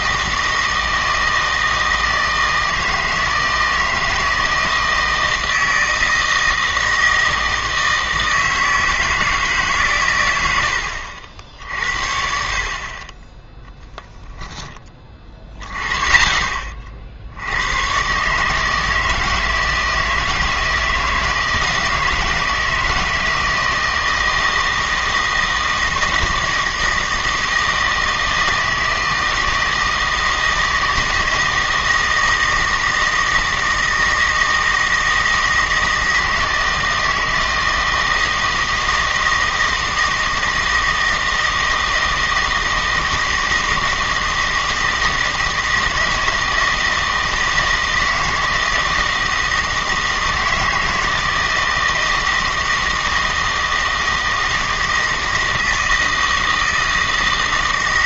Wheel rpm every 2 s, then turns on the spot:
160, 160, 160, 160, 160, 80, 50, 10, 30, 160, 160, 160, 160, 160, 160, 160, 160, 160, 160, 160, 160, 160, 160, 160, 160, 160, 160, 160, 160.
none